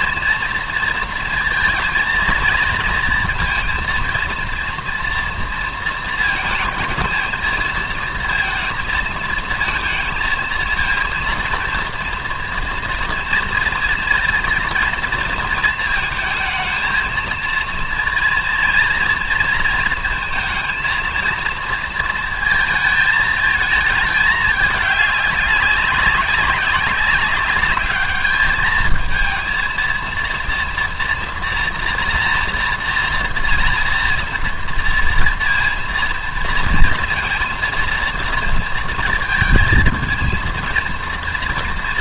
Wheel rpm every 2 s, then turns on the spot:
230, 230, 230, 220, 230, 230, 230, 230, 230, 230, 230, 230, 210, 200, 210, 230, 230, 230, 230, 230, 230.
none